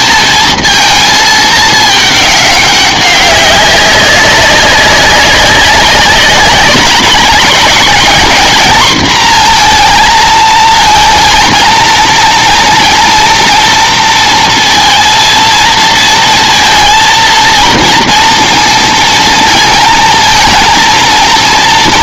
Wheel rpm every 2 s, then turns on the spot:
220, 200, 190, 190, 220, 220, 230, 230, 230, 230, 230.
none